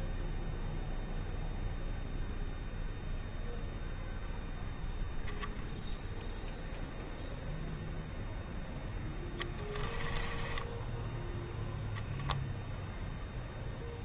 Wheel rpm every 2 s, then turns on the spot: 0, 0, 0, 0, 20, 0, 0.
8-10